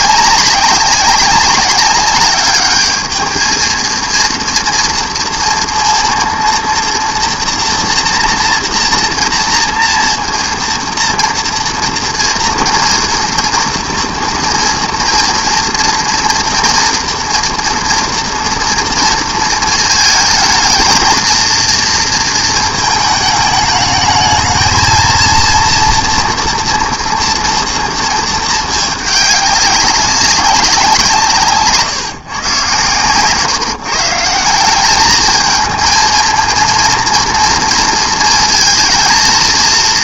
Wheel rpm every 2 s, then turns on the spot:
200, 210, 230, 230, 240, 240, 230, 230, 230, 230, 220, 230, 230, 230, 210, 190, 130, 180, 230, 220.
none